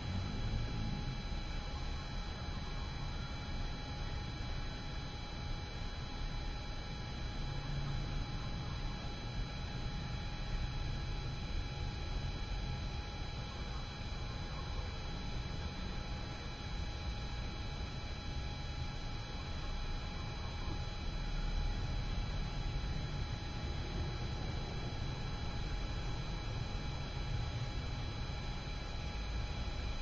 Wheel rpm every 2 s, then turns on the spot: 0, 0, 0, 0, 0, 0, 0, 0, 0, 0, 0, 0, 0, 0, 0.
none